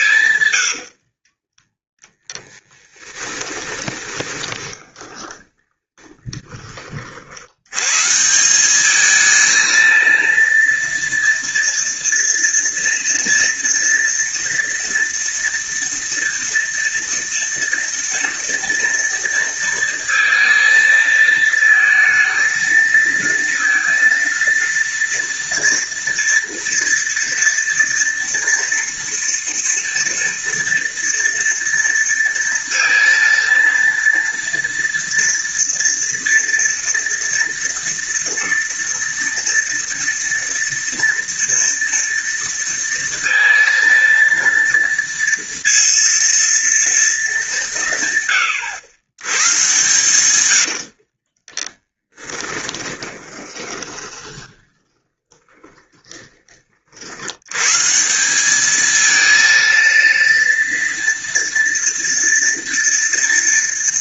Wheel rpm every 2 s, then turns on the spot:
50, 10, 20, 60, 220, 230, 230, 230, 230, 230, 230, 230, 230, 230, 230, 230, 230, 230, 230, 230, 230, 230, 230, 200, 110, 40, 20, 30, 80, 230, 230, 230.
0-6 50-56